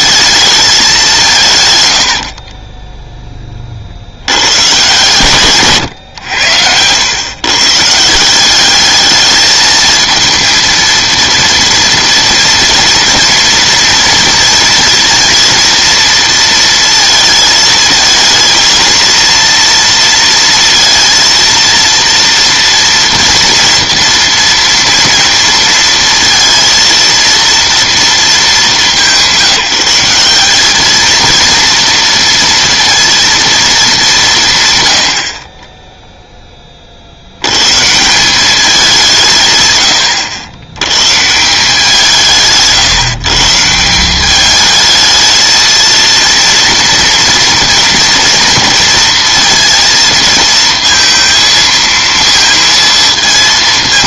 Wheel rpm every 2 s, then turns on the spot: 210, 20, 120, 90, 210, 230, 240, 230, 230, 230, 230, 230, 230, 230, 200, 210, 230, 120, 30, 190, 120, 140, 220, 230, 230, 220, 230.
none